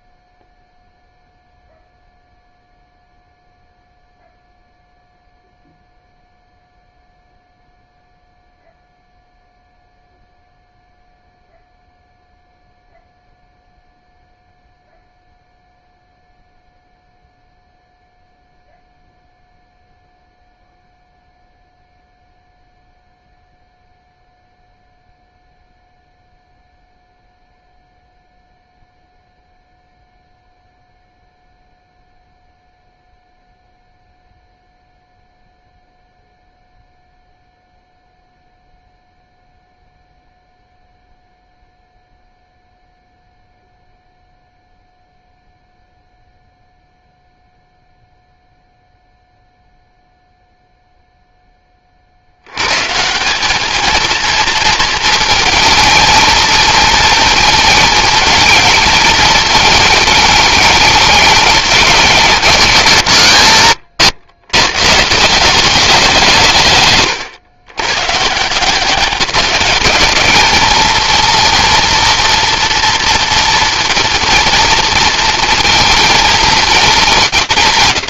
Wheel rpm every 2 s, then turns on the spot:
0, 0, 0, 0, 0, 0, 0, 0, 0, 0, 0, 0, 0, 0, 0, 0, 0, 0, 0, 0, 0, 0, 0, 0, 0, 0, 110, 230, 230, 220, 210, 170, 130, 160, 170, 210, 240, 230, 200.
none